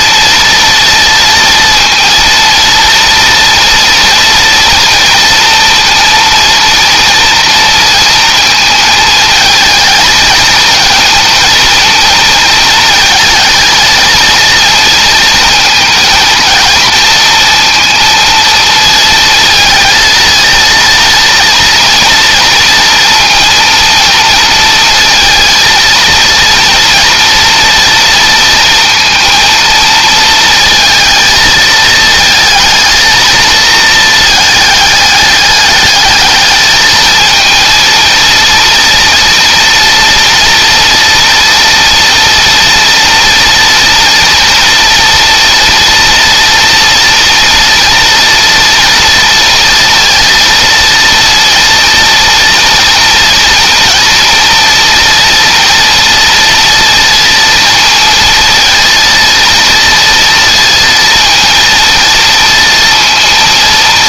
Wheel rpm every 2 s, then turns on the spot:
230, 230, 240, 230, 220, 230, 220, 230, 230, 230, 230, 240, 230, 230, 230, 230, 220, 210, 220, 230, 230, 230, 230, 230, 230, 230, 230, 230, 230, 230, 230, 230.
none